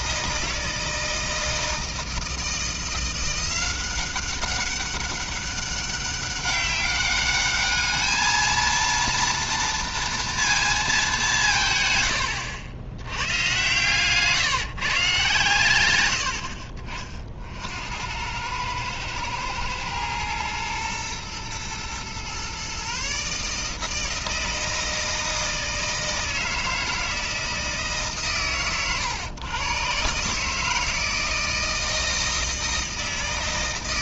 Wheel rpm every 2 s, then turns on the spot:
160, 170, 200, 200, 230, 220, 90, 130, 50, 110, 120, 140, 160, 160, 120, 160, 160.
none